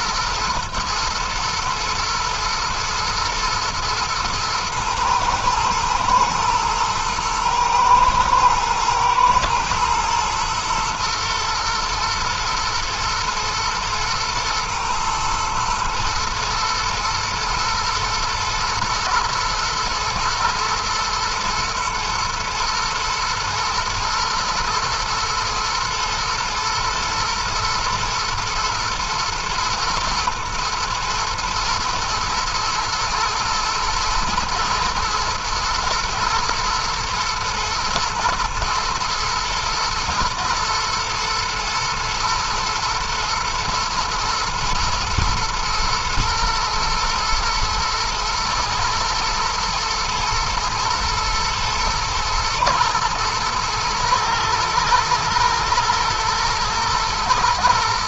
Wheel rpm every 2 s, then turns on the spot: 110, 110, 110, 110, 110, 110, 110, 110, 120, 120, 110, 120, 110, 110, 120, 110, 110, 120, 110, 110, 110, 110, 110, 110, 120, 110, 120, 110, 120.
none